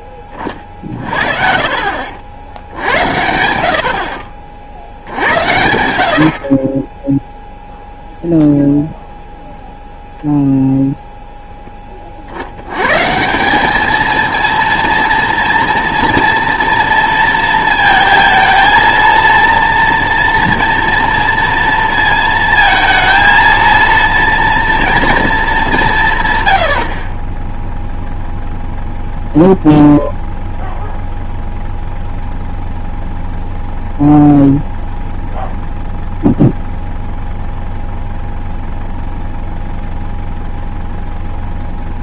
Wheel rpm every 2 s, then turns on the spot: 40, 80, 50, 40, 0, 0, 100, 230, 230, 230, 230, 230, 230, 80, 0, 0, 0, 0, 0, 0, 0.
26-28